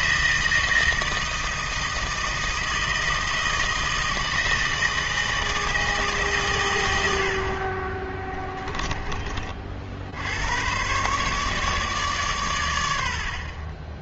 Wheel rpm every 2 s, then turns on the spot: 160, 160, 160, 110, 10, 110, 110.
8-10